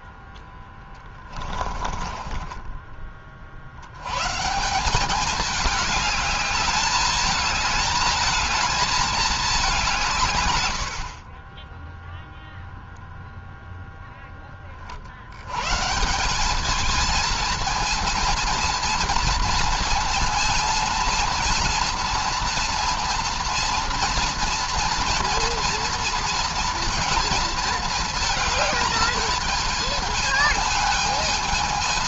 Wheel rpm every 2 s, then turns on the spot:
30, 30, 190, 210, 220, 70, 0, 50, 220, 230, 230, 230, 240, 230, 220, 220.
0-2 10-12